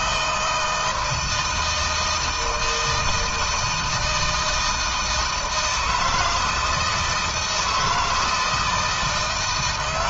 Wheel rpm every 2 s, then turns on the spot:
160, 160, 160, 160, 150.
none